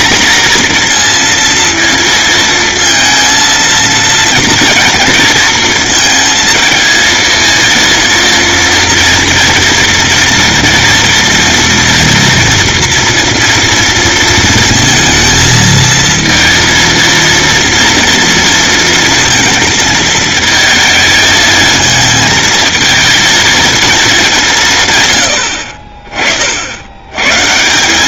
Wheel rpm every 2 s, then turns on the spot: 230, 230, 230, 230, 230, 230, 230, 230, 230, 230, 220, 230, 80, 150.
none